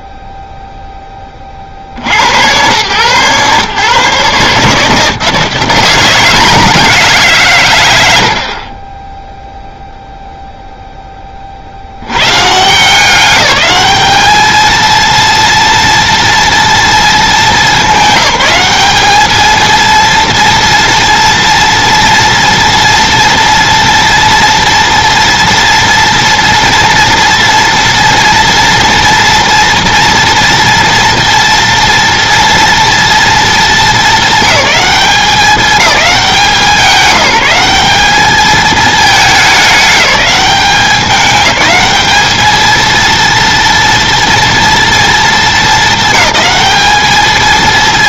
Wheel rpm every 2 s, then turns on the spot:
0, 110, 150, 170, 40, 0, 150, 220, 230, 200, 230, 230, 230, 230, 230, 230, 230, 200, 190, 210, 200, 220, 230, 210.
none